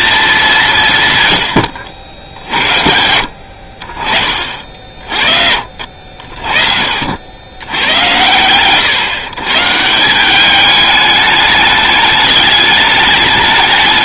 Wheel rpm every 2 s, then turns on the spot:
180, 70, 40, 50, 110, 200, 210.
none